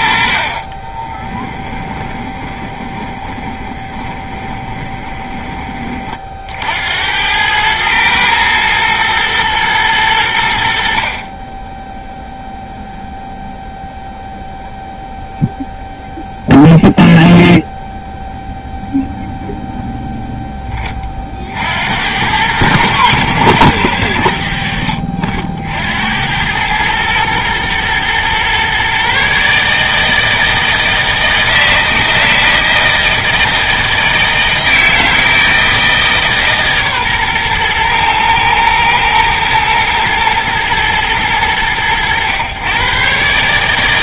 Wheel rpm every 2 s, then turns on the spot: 30, 30, 30, 80, 110, 70, 0, 0, 0, 0, 20, 100, 70, 110, 130, 160, 160, 160, 140, 110, 110, 120.
0-6